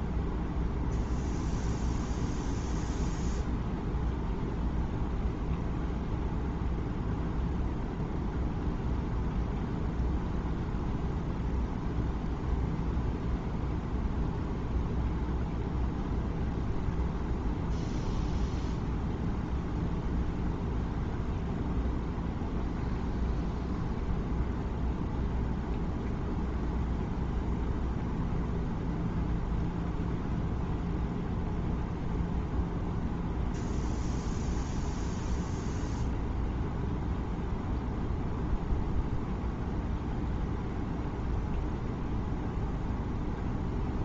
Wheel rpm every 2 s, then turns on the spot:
0, 0, 0, 0, 0, 0, 0, 0, 0, 0, 0, 0, 0, 0, 0, 0, 0, 0, 0, 0, 0, 0.
none